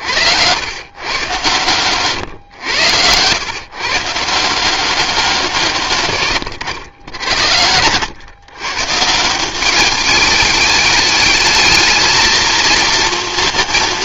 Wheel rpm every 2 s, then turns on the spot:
100, 110, 170, 120, 130, 210, 230.
none